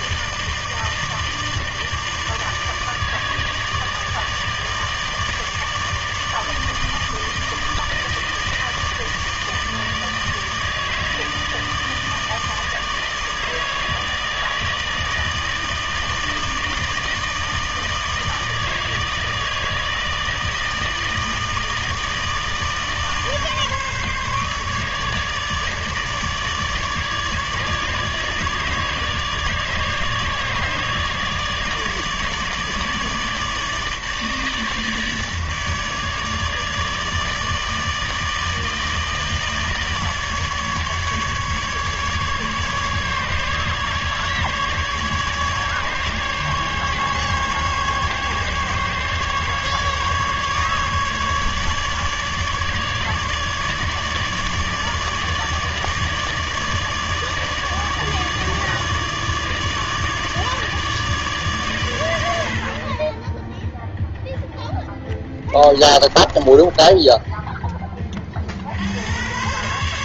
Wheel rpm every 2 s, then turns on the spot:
160, 160, 150, 150, 160, 160, 160, 160, 160, 160, 160, 160, 150, 150, 150, 150, 150, 150, 150, 160, 150, 150, 150, 140, 140, 150, 150, 150, 150, 150, 150, 70, 0, 20, 50.
66-68